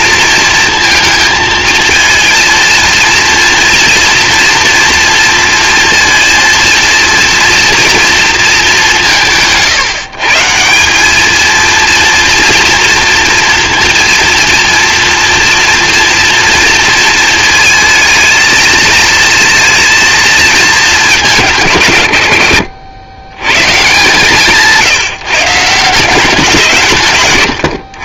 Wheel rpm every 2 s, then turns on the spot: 230, 230, 230, 230, 200, 170, 230, 230, 230, 220, 230, 90, 160, 180.
none